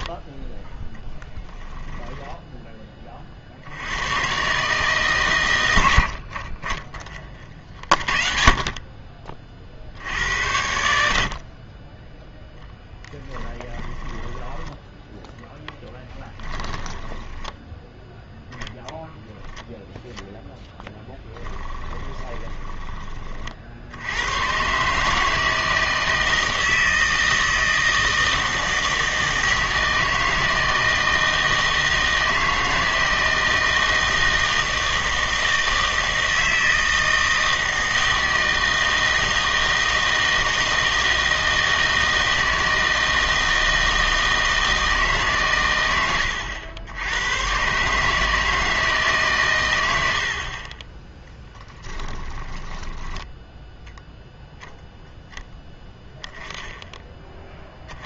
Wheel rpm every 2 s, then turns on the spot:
10, 10, 130, 40, 40, 90, 0, 10, 10, 10, 10, 20, 130, 160, 160, 160, 160, 160, 160, 160, 160, 160, 160, 80, 160, 30, 20, 0, 10.
16-18 22-24 52-54